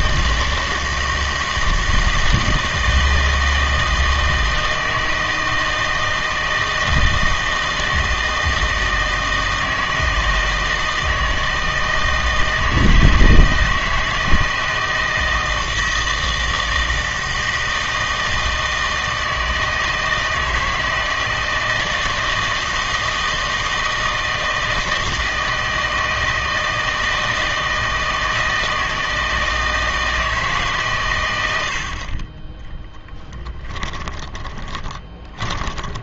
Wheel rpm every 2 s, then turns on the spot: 160, 160, 160, 160, 160, 160, 160, 160, 160, 160, 160, 160, 160, 160, 160, 140, 10, 20.
32-36